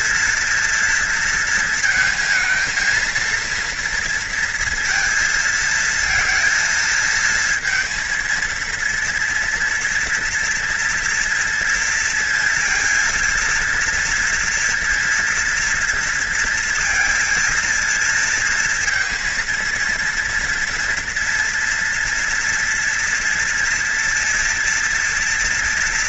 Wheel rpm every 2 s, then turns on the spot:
230, 220, 230, 230, 230, 230, 230, 240, 230, 230, 230, 230, 230.
none